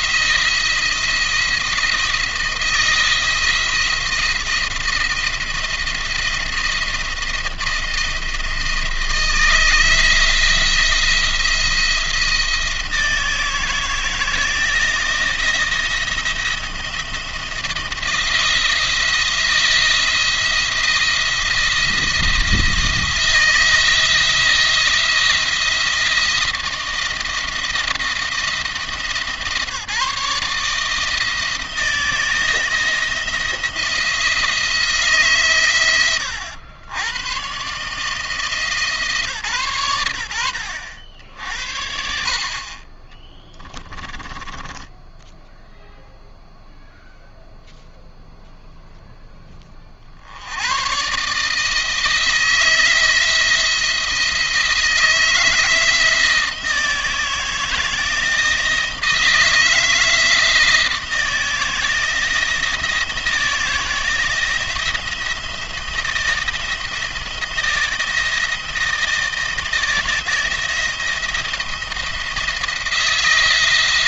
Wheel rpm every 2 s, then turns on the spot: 170, 160, 170, 170, 170, 170, 160, 170, 170, 170, 170, 170, 170, 160, 160, 160, 160, 160, 90, 160, 80, 40, 10, 0, 0, 90, 160, 170, 160, 160, 160, 160, 170, 170, 170, 170, 170.
44-46